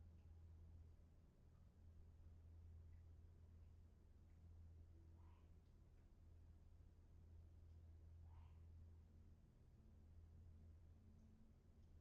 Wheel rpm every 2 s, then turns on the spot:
0, 0, 0, 0, 0, 0.
none